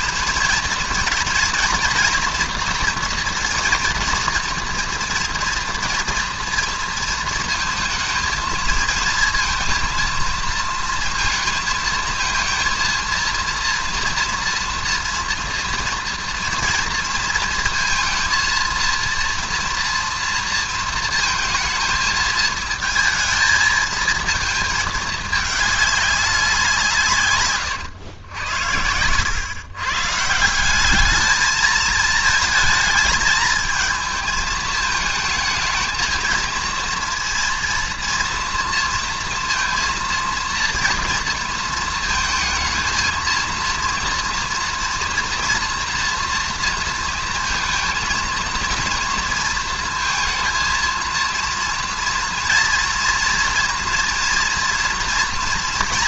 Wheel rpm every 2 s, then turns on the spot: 230, 240, 230, 230, 220, 230, 230, 230, 230, 230, 230, 220, 220, 190, 110, 160, 220, 220, 230, 230, 230, 230, 230, 230, 230, 230, 230, 230.
none